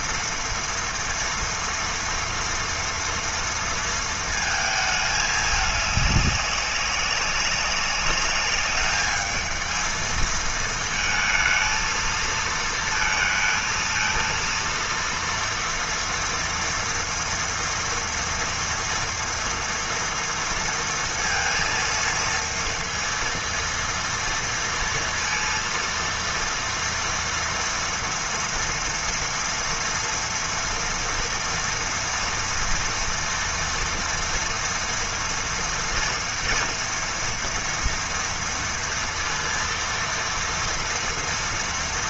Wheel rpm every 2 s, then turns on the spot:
230, 240, 220, 200, 200, 220, 230, 230, 230, 230, 230, 230, 230, 230, 230, 230, 230, 230, 230, 230, 230.
none